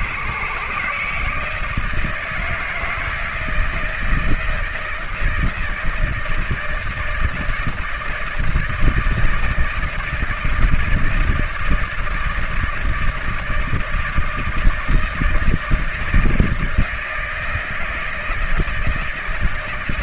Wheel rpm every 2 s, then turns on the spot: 140, 160, 160, 160, 170, 160, 160, 160, 160, 160.
none